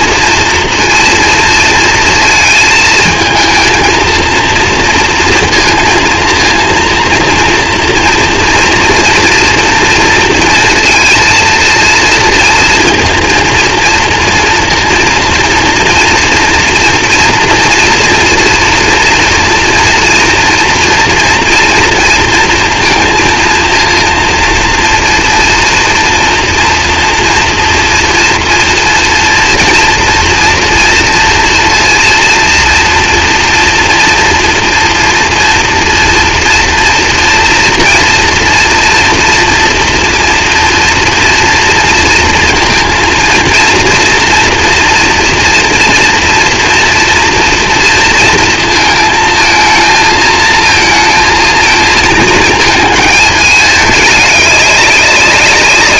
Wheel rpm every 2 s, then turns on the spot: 230, 220, 230, 230, 240, 230, 230, 230, 230, 230, 240, 230, 230, 240, 230, 230, 230, 230, 230, 230, 240, 230, 240, 230, 230, 220, 220, 200.
none